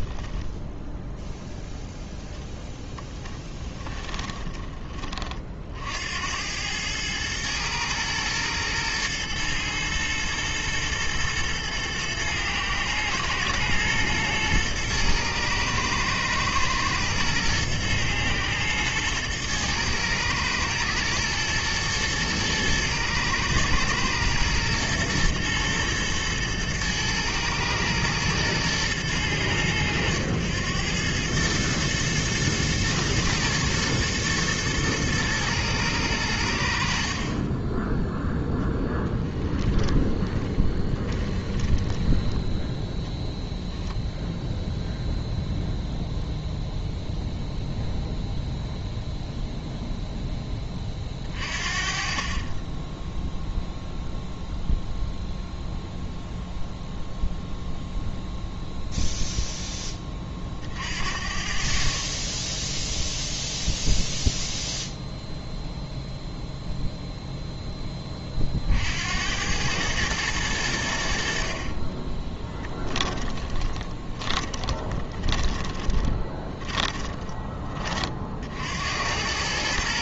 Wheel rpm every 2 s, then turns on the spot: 10, 10, 20, 100, 110, 110, 110, 110, 110, 110, 110, 120, 120, 110, 110, 100, 110, 120, 60, 10, 20, 10, 0, 0, 0, 20, 20, 0, 0, 0, 50, 0, 0, 0, 60, 90, 20, 30, 20, 70.
0-2 38-42 72-78